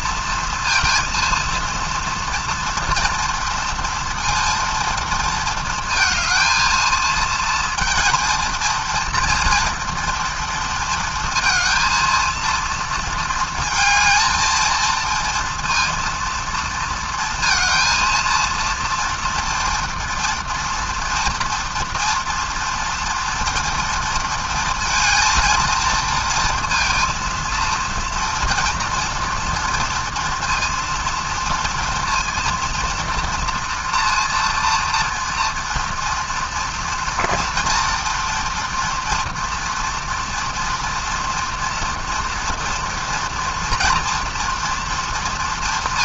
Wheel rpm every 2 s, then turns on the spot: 230, 230, 230, 230, 230, 230, 230, 230, 230, 230, 240, 230, 230, 230, 230, 230, 230, 230, 230, 240, 240, 240, 240.
none